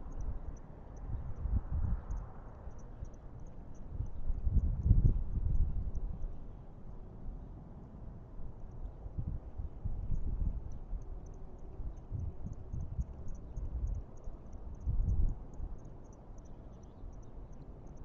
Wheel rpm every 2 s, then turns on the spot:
0, 0, 0, 0, 0, 0, 0, 0, 0.
none